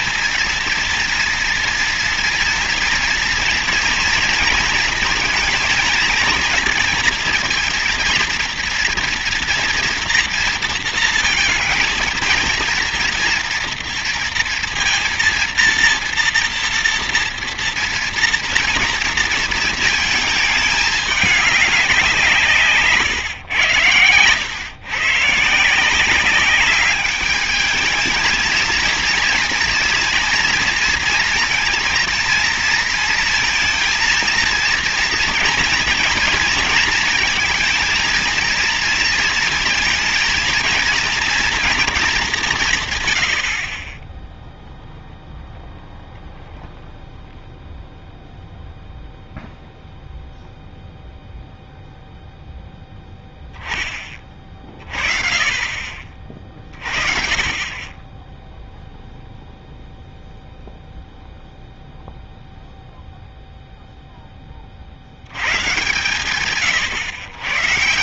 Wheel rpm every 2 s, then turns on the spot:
230, 230, 230, 230, 230, 230, 230, 230, 230, 230, 210, 150, 120, 200, 230, 230, 230, 230, 230, 230, 230, 130, 0, 0, 0, 0, 0, 40, 40, 0, 0, 0, 30, 120.
none